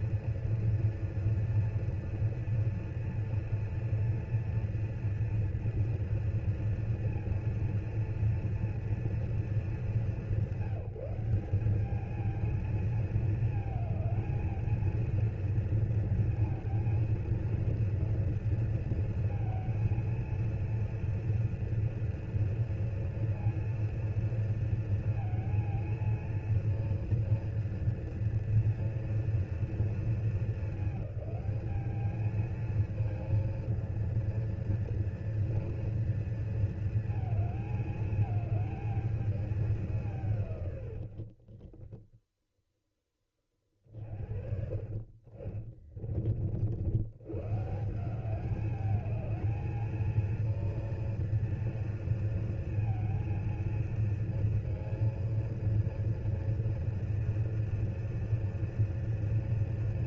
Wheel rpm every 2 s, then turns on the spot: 240, 230, 240, 230, 230, 180, 220, 220, 230, 230, 230, 240, 230, 230, 230, 220, 220, 230, 230, 220, 140, 0, 50, 70, 200, 230, 230, 230, 230, 230.
44-46